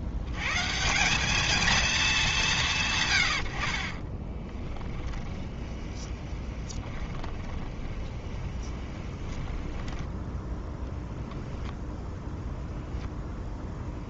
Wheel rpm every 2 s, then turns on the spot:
140, 170, 10, 20, 20, 10, 0.
4-10